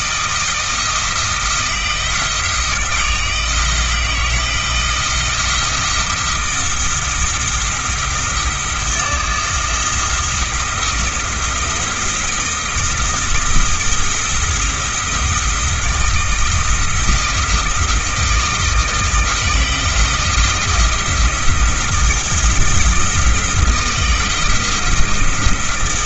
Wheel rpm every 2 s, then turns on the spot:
160, 160, 160, 170, 170, 170, 170, 170, 160, 160, 160, 170, 170.
none